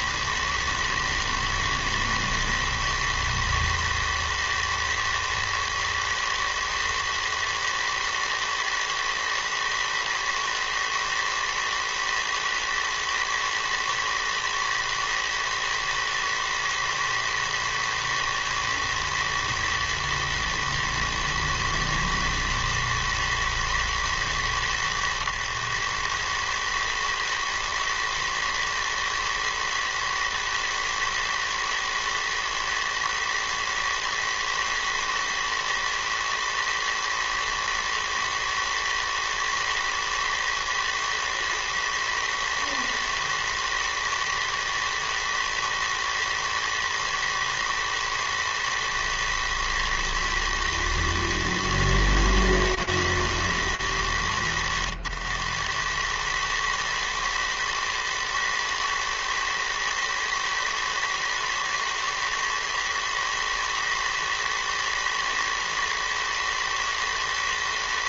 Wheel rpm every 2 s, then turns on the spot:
110, 110, 110, 120, 110, 110, 110, 110, 110, 110, 110, 110, 90, 110, 110, 110, 110, 110, 110, 110, 110, 110, 110, 110, 110, 120, 110, 80, 110, 110, 110, 110, 110, 110.
none